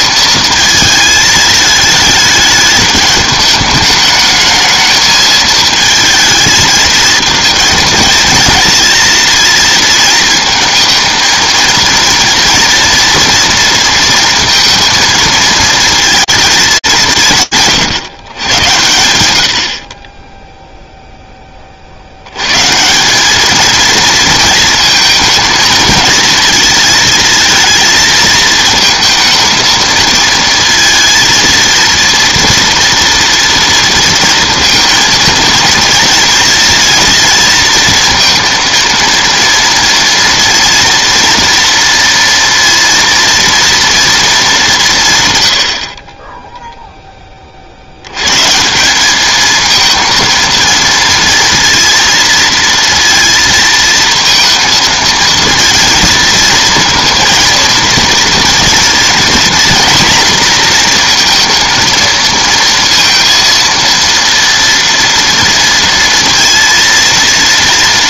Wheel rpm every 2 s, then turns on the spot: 220, 210, 220, 220, 220, 220, 230, 230, 210, 110, 0, 140, 220, 220, 220, 230, 230, 230, 230, 230, 230, 230, 190, 10, 190, 220, 230, 230, 230, 230, 230, 230, 230, 230.
none